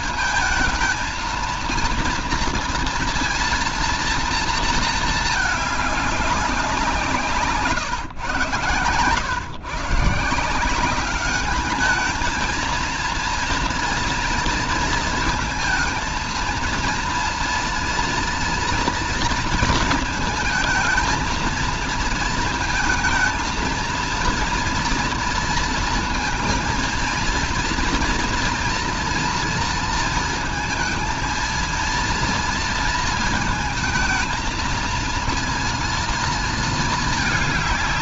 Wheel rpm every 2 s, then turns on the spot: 220, 230, 230, 180, 120, 170, 220, 230, 230, 230, 220, 230, 230, 230, 240, 230, 230, 230, 230.
none